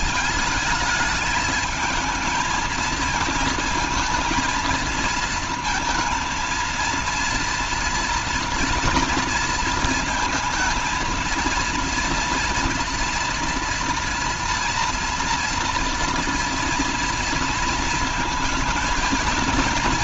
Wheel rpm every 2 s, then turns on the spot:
220, 220, 230, 230, 230, 230, 230, 230, 230, 220.
none